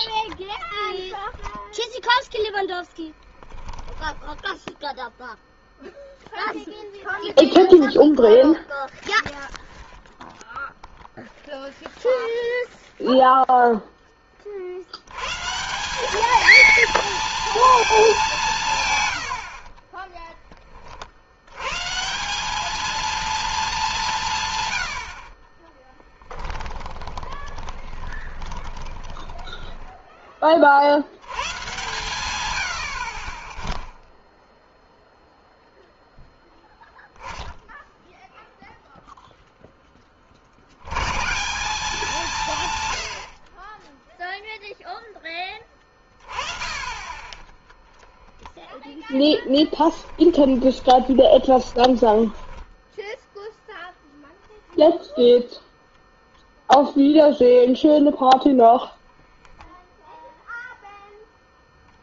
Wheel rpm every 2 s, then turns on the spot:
0, 0, 0, 0, 0, 0, 30, 210, 190, 30, 180, 180, 10, 20, 10, 120, 0, 0, 10, 0, 170, 30, 10, 10, 20, 20, 10, 0, 0, 0, 0.
24-28 46-52